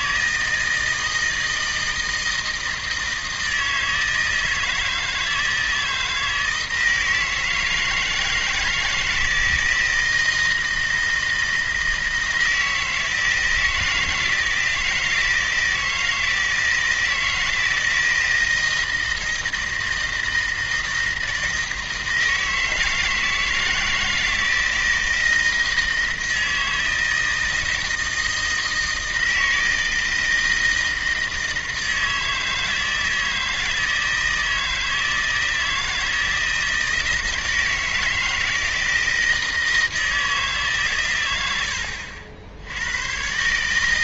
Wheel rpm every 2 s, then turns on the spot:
160, 160, 160, 160, 160, 160, 160, 160, 160, 160, 160, 160, 160, 160, 160, 160, 160, 160, 160, 160, 130, 90.
none